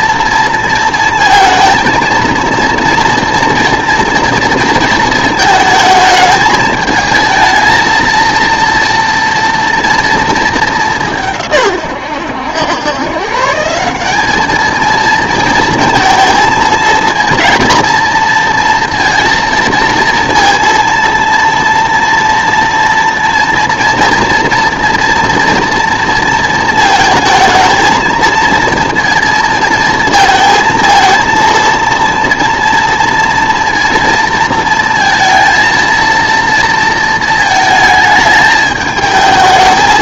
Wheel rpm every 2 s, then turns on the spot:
230, 230, 230, 220, 230, 200, 110, 220, 220, 230, 230, 230, 230, 230, 230, 230, 230, 230, 230, 220.
none